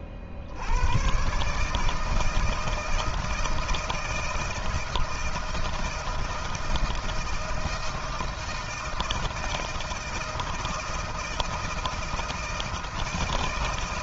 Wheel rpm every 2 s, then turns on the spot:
50, 160, 160, 160, 160, 160, 160.
none